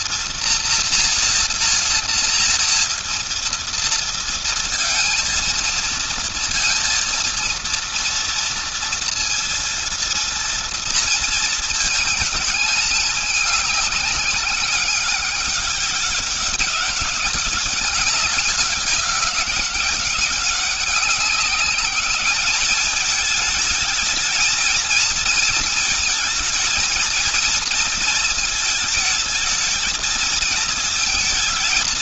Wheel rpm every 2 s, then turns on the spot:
230, 230, 230, 230, 230, 230, 210, 200, 190, 200, 200, 210, 230, 220, 220, 220.
none